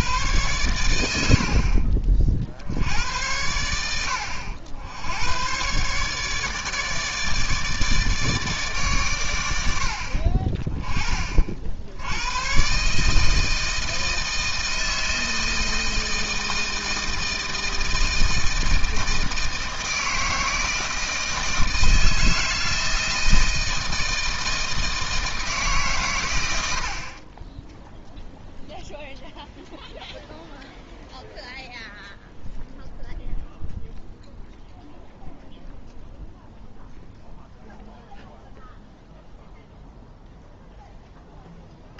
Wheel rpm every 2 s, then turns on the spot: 110, 70, 80, 150, 140, 30, 140, 160, 160, 160, 160, 160, 160, 70, 0, 0, 0, 0, 0, 0, 0.
none